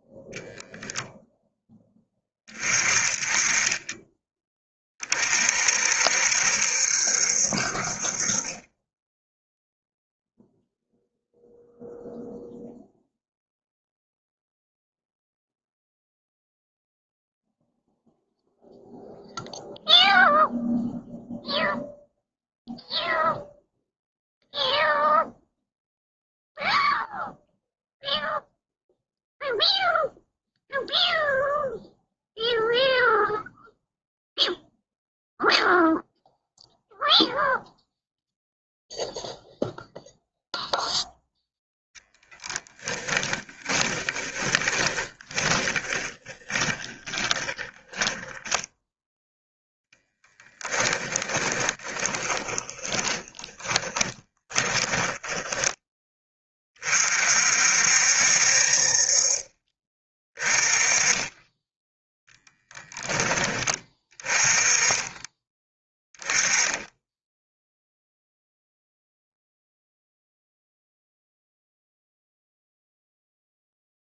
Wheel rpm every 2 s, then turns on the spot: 0, 30, 30, 70, 20, 0, 0, 0, 0, 0, 0, 0, 0, 0, 0, 0, 0, 0, 0, 0, 0, 10, 20, 20, 10, 10, 20, 20, 30, 50, 20, 10, 20, 10, 0, 0, 0.
42-48 50-56